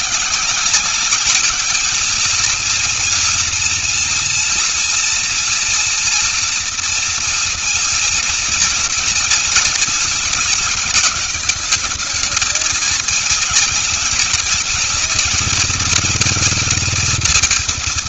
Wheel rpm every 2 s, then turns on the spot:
180, 230, 230, 230, 230, 230, 220, 230, 230.
none